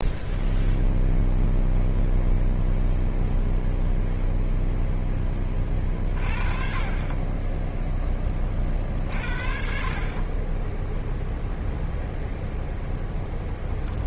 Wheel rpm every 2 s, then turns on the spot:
0, 0, 0, 30, 50, 0, 0.
none